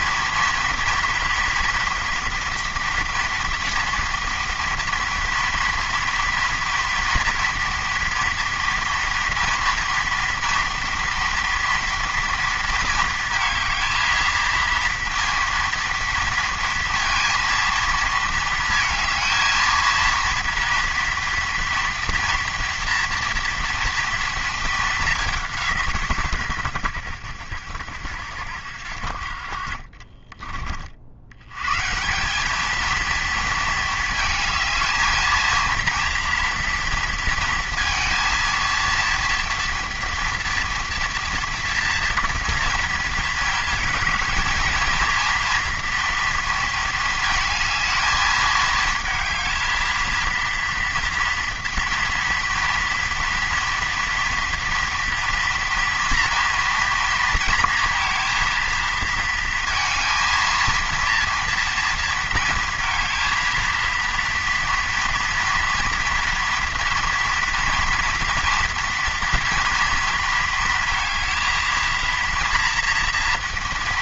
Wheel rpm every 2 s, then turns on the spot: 230, 240, 230, 230, 230, 230, 230, 230, 230, 230, 230, 230, 220, 110, 70, 40, 210, 220, 230, 230, 230, 230, 220, 230, 220, 230, 230, 230, 230, 230, 230, 230, 230, 230, 240, 230, 230.
none